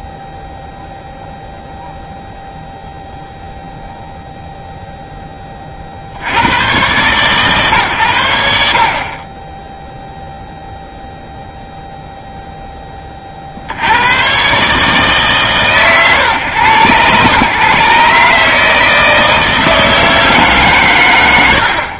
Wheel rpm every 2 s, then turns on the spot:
0, 0, 0, 80, 40, 0, 10, 140, 120, 160, 120.
none